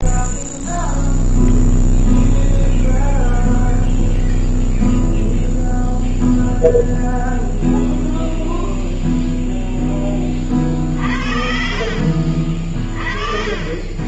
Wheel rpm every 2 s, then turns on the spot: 0, 0, 0, 0, 0, 10, 50.
12-14